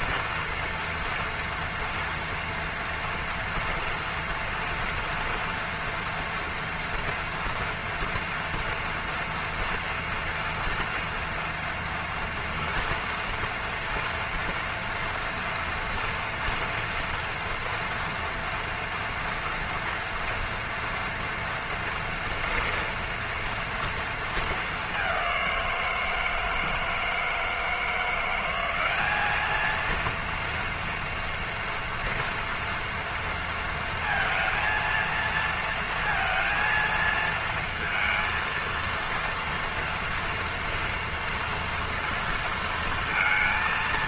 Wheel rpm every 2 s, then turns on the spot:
240, 230, 230, 230, 230, 240, 240, 230, 230, 240, 240, 230, 230, 170, 170, 230, 230, 230, 230, 230, 240, 230.
none